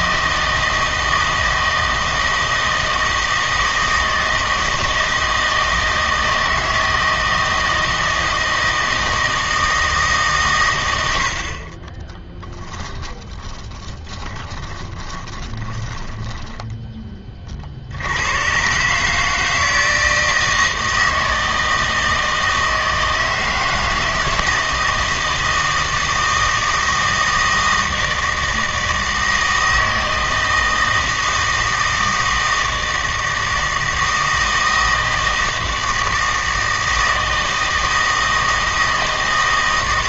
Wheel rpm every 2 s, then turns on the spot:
160, 160, 160, 160, 160, 120, 10, 20, 10, 130, 160, 160, 160, 160, 160, 160, 160, 160, 160, 160.
12-16